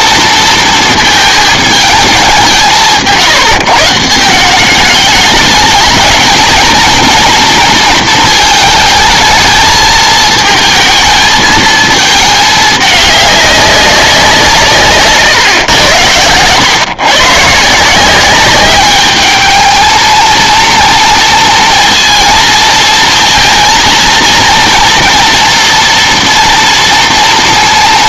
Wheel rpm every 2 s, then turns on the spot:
220, 170, 200, 220, 220, 220, 210, 160, 120, 200, 230, 230, 230, 230.
none